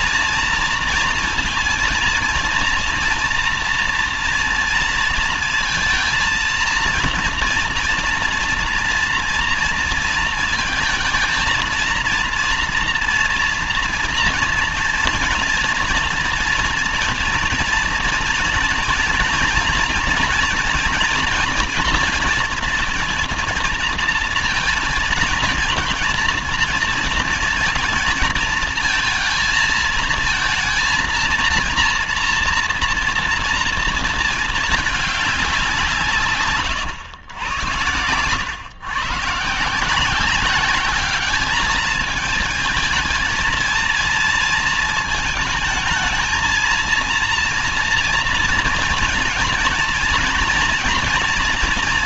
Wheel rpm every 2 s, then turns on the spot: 230, 230, 230, 230, 230, 220, 230, 230, 230, 230, 230, 230, 230, 230, 230, 230, 230, 220, 120, 120, 200, 220, 220, 230, 230, 240.
none